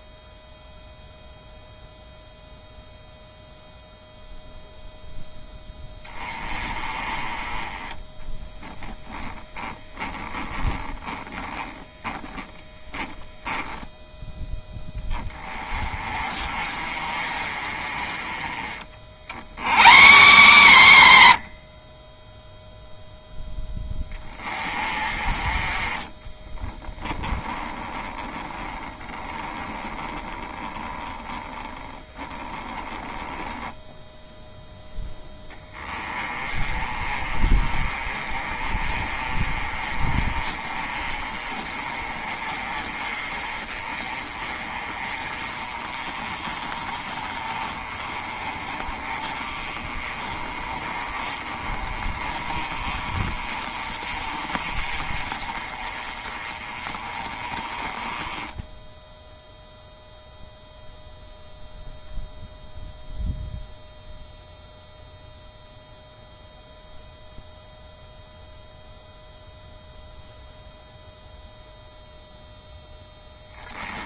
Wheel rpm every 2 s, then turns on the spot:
0, 0, 0, 20, 10, 10, 10, 20, 40, 30, 90, 0, 30, 10, 20, 10, 10, 10, 30, 30, 30, 30, 30, 30, 30, 30, 30, 30, 30, 10, 0, 0, 0, 0, 0, 0, 0.
10-12 26-34